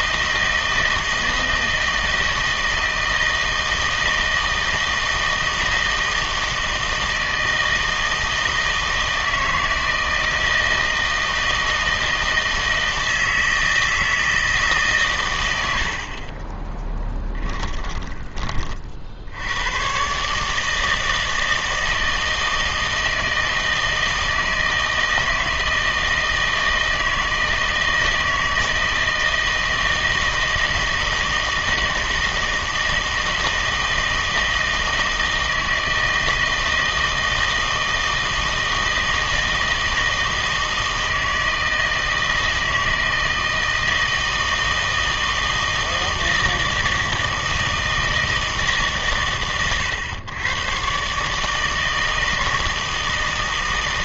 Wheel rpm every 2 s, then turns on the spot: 160, 160, 160, 160, 160, 160, 160, 150, 10, 40, 150, 160, 160, 160, 160, 160, 160, 160, 160, 160, 160, 160, 160, 160, 160, 120, 160.
16-18